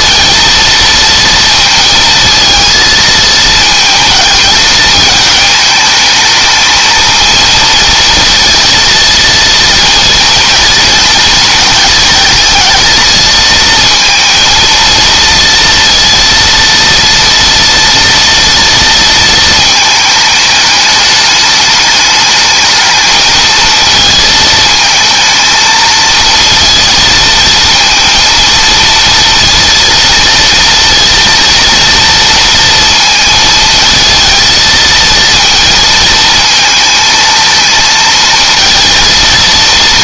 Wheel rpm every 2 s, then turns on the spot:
230, 230, 220, 220, 230, 230, 230, 230, 230, 230, 210, 220, 220, 230, 230, 230, 230, 220, 220, 230.
none